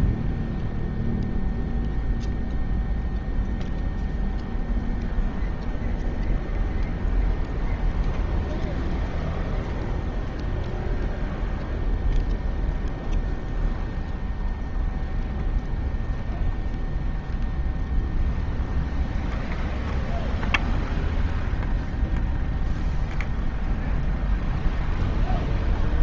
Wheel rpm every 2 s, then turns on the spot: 0, 0, 0, 0, 0, 0, 0, 0, 0, 0, 0, 0, 0.
none